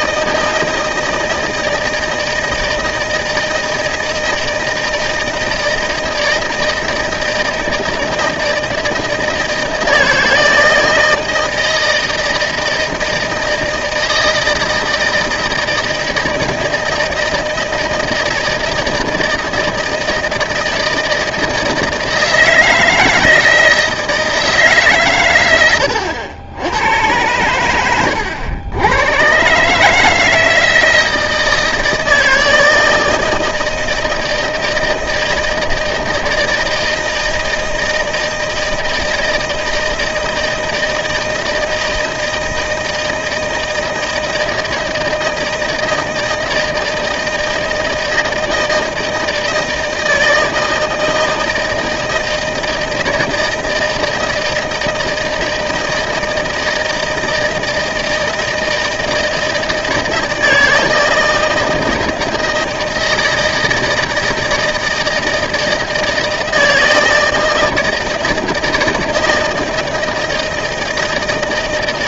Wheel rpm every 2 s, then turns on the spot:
160, 160, 160, 160, 160, 160, 160, 160, 160, 160, 160, 160, 160, 100, 90, 160, 160, 160, 160, 160, 160, 160, 160, 160, 160, 160, 160, 160, 160, 160, 160, 160, 160, 160, 160, 160.
none